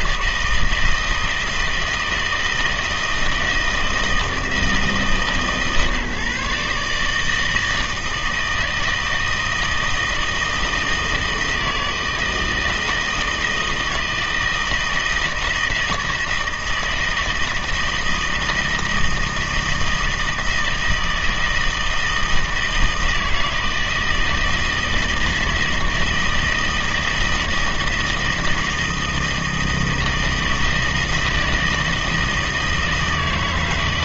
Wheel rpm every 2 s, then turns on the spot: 160, 160, 160, 140, 160, 160, 160, 160, 160, 160, 160, 160, 160, 160, 160, 160, 160.
none